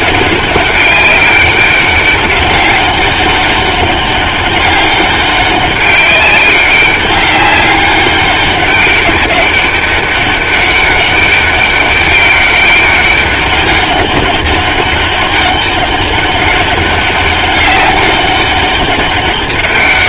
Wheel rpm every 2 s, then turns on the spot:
200, 200, 200, 200, 190, 200, 200, 200, 200, 200.
none